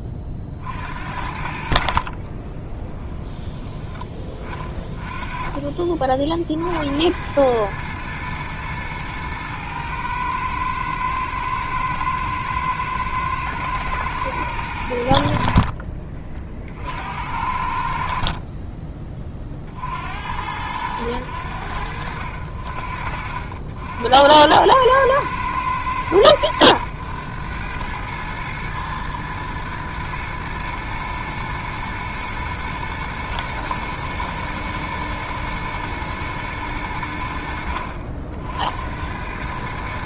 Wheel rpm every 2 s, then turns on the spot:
50, 20, 30, 70, 110, 110, 110, 100, 50, 30, 90, 60, 100, 100, 110, 120, 110, 120, 100, 70.
2-4